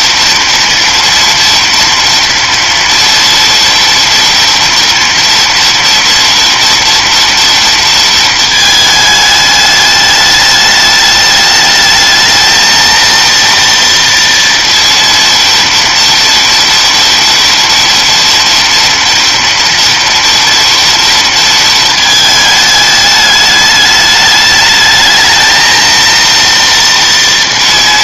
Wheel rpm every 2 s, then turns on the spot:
230, 230, 230, 230, 220, 210, 220, 230, 230, 230, 230, 210, 210, 230.
none